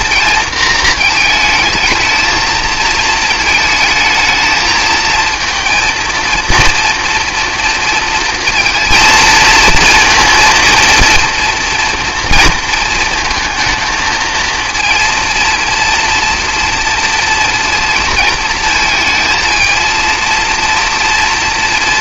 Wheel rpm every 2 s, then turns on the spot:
220, 220, 220, 230, 230, 230, 230, 230, 240, 230, 240.
none